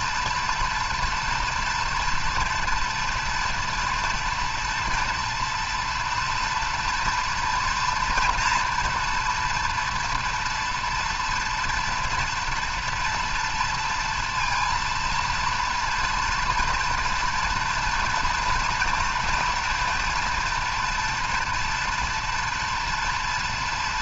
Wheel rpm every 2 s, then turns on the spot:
240, 230, 240, 230, 230, 240, 240, 230, 230, 230, 240, 230.
none